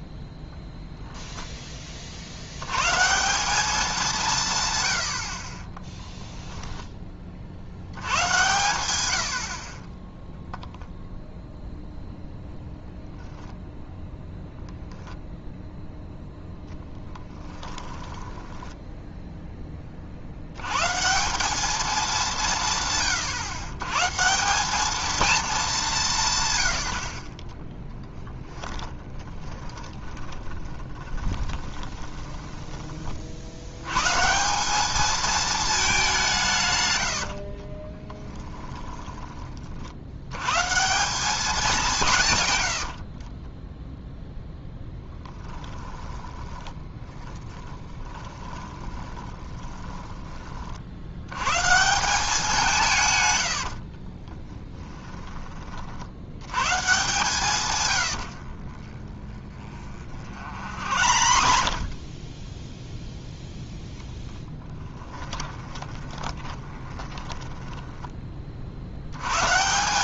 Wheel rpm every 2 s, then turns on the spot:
0, 110, 120, 10, 120, 0, 0, 0, 10, 10, 120, 140, 190, 90, 20, 20, 20, 190, 120, 10, 140, 90, 10, 20, 20, 50, 180, 10, 120, 30, 60, 10, 20, 20, 50.
18-20 28-34 38-40 42-44 46-50 54-56 58-62 64-68